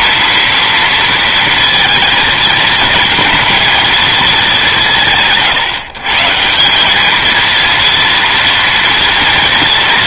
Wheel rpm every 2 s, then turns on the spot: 230, 230, 190, 180, 240.
none